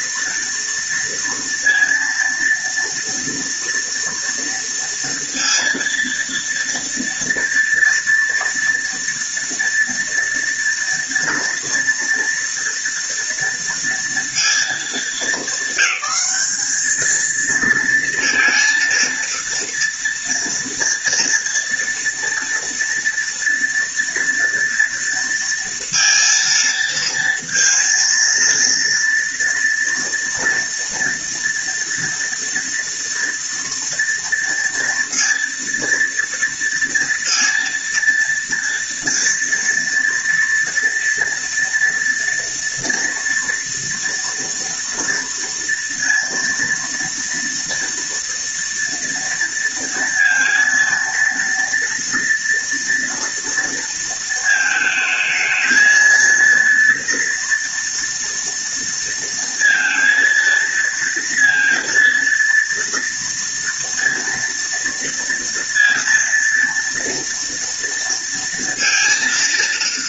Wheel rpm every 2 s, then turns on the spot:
240, 230, 230, 230, 230, 230, 230, 230, 220, 230, 230, 230, 230, 230, 230, 230, 230, 230, 230, 240, 240, 230, 230, 230, 230, 230, 230, 220, 230, 230, 230, 230, 230, 230, 230.
none